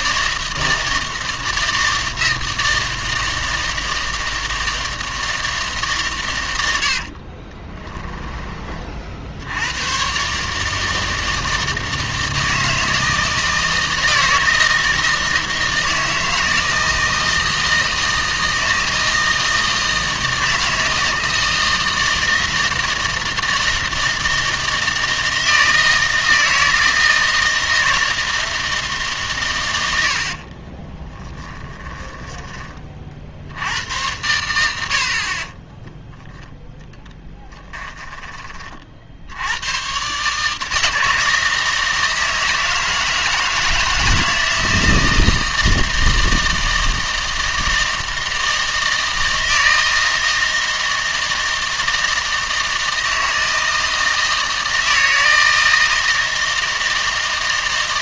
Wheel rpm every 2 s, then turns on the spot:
160, 160, 160, 110, 30, 150, 160, 160, 160, 160, 160, 160, 160, 160, 160, 40, 20, 90, 20, 40, 150, 160, 160, 160, 160, 160, 160, 160, 160.
30-32